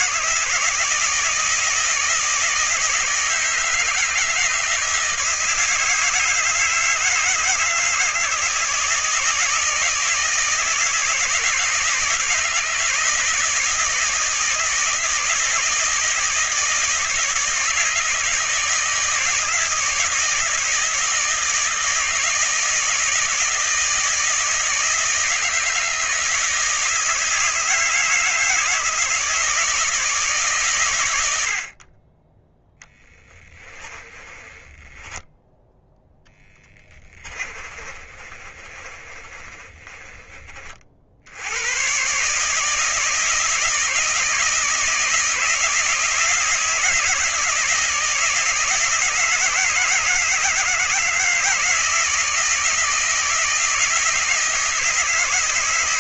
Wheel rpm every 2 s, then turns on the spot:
160, 160, 160, 160, 160, 160, 160, 160, 160, 160, 160, 160, 160, 160, 160, 110, 10, 10, 20, 30, 50, 160, 160, 160, 160, 160, 160, 160.
32-40